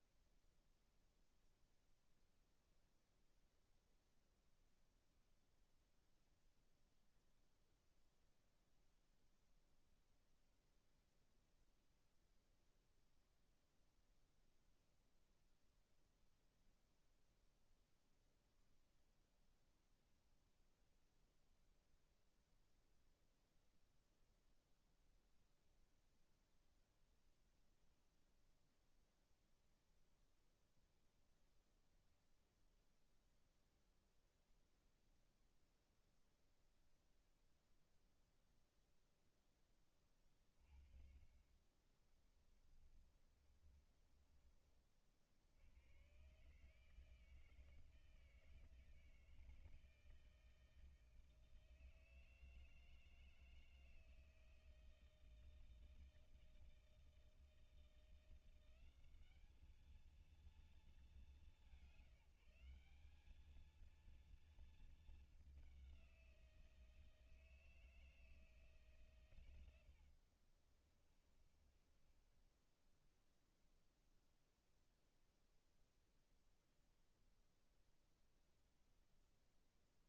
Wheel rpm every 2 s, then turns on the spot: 0, 0, 0, 0, 0, 0, 0, 0, 0, 0, 0, 0, 0, 0, 0, 0, 0, 0, 0, 0, 30, 30, 50, 160, 160, 160, 160, 160, 160, 200, 190, 200, 220, 160, 130, 30, 0, 0, 0, 0.
40-44 70-72